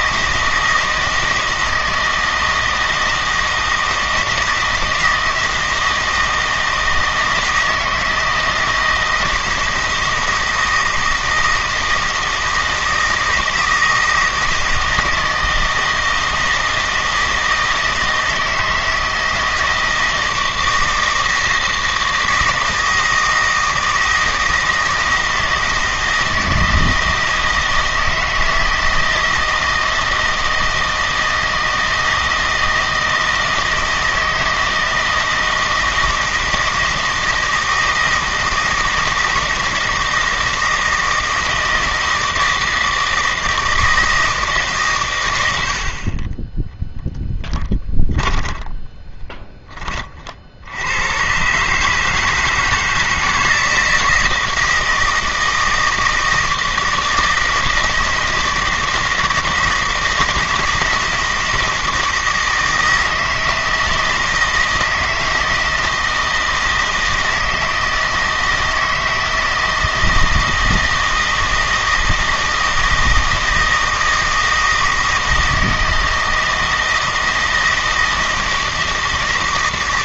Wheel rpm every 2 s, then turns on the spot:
160, 160, 160, 160, 160, 160, 160, 160, 160, 160, 160, 160, 160, 160, 160, 160, 160, 160, 160, 160, 160, 160, 140, 0, 10, 90, 170, 160, 160, 160, 160, 160, 160, 160, 160, 160, 160, 160, 160, 160.
48-50